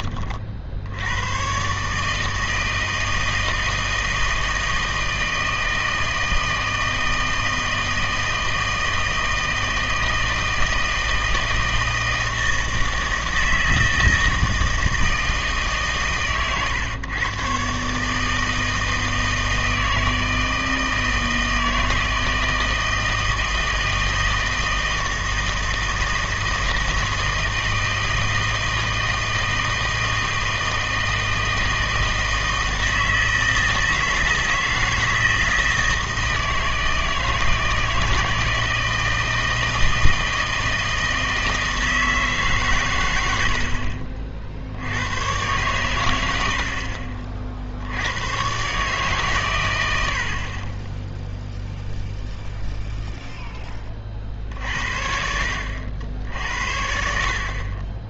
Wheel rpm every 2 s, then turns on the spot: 50, 160, 160, 160, 160, 160, 160, 160, 120, 160, 160, 160, 160, 160, 160, 160, 160, 160, 160, 160, 160, 140, 60, 70, 130, 30, 0, 50, 60.
none